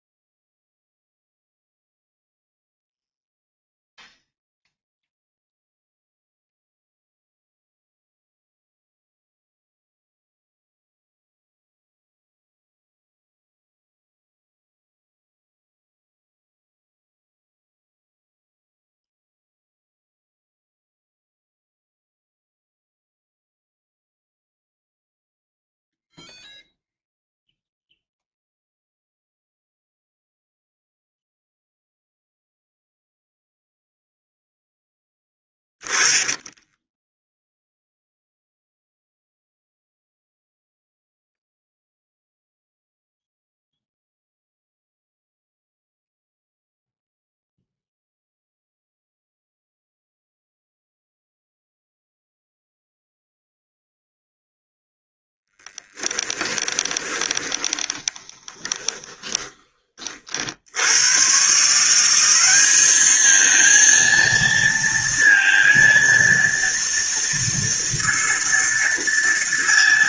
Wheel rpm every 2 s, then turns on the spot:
0, 0, 0, 0, 0, 0, 0, 0, 0, 0, 0, 0, 0, 0, 0, 0, 0, 0, 10, 0, 0, 0, 0, 0, 0, 0, 0, 0, 20, 20, 90, 210, 230, 230, 230.
36-38 56-60